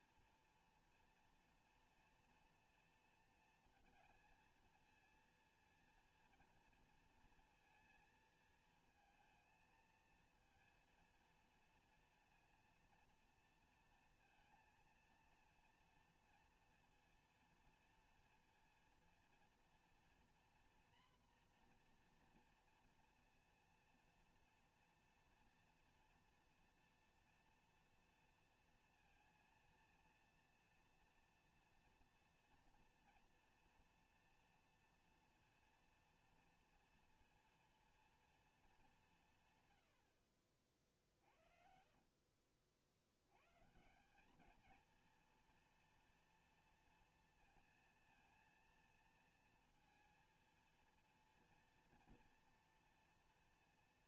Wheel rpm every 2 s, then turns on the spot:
230, 230, 230, 230, 230, 230, 230, 230, 230, 230, 240, 240, 240, 230, 230, 230, 230, 230, 230, 220, 50, 50, 200, 230, 230, 230, 230.
none